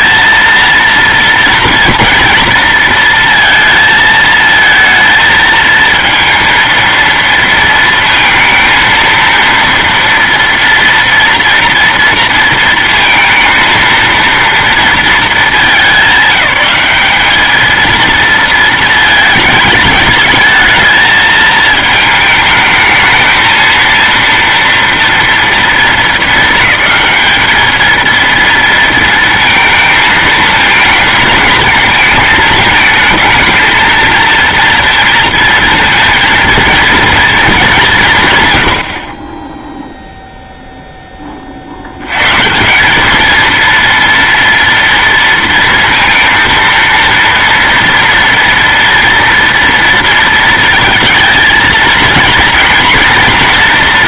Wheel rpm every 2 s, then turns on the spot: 230, 230, 220, 230, 230, 230, 230, 230, 200, 230, 220, 220, 230, 220, 230, 230, 220, 230, 230, 100, 0, 160, 230, 230, 230, 230, 230.
none